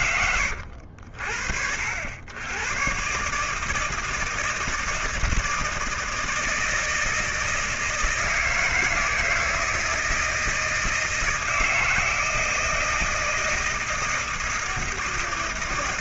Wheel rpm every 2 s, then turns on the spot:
60, 130, 160, 160, 160, 160, 160, 160.
none